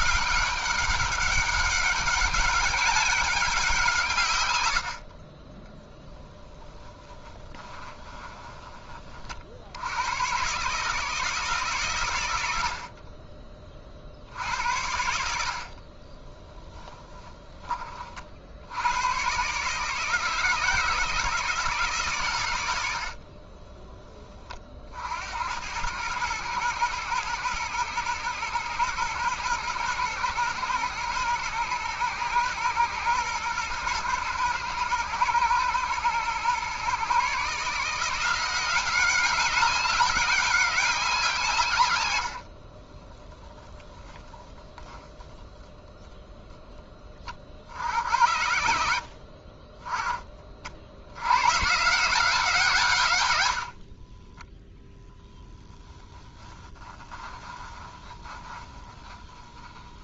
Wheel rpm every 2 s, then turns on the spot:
200, 190, 90, 10, 20, 140, 70, 70, 10, 80, 160, 100, 40, 110, 110, 120, 120, 110, 120, 180, 200, 40, 0, 0, 70, 50, 160, 10, 20, 10.
6-8 16-18 42-44 56-60